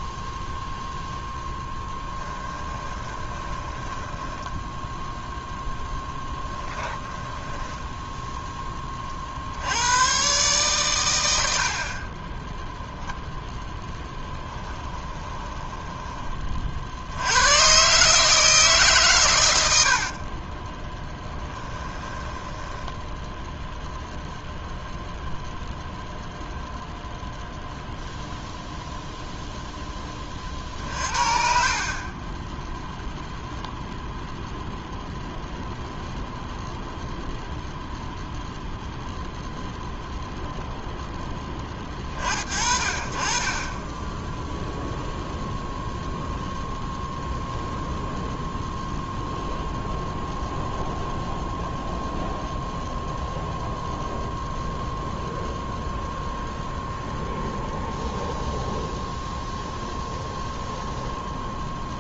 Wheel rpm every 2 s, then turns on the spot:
0, 20, 0, 10, 20, 120, 0, 20, 50, 150, 10, 10, 0, 0, 0, 50, 10, 0, 0, 0, 0, 40, 0, 0, 0, 0, 0, 0, 0, 0, 0.
2-4 6-8 14-16 20-24